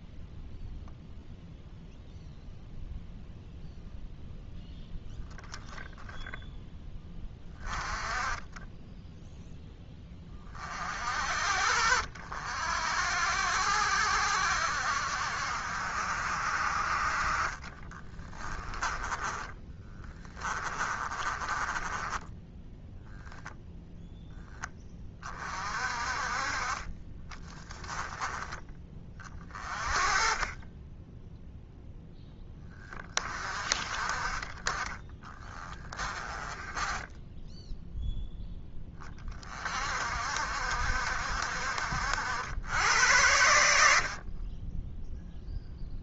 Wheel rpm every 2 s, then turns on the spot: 0, 0, 0, 0, 10, 40, 60, 60, 50, 20, 20, 10, 10, 30, 20, 10, 20, 20, 20, 10, 60, 90, 10.
18-24 36-38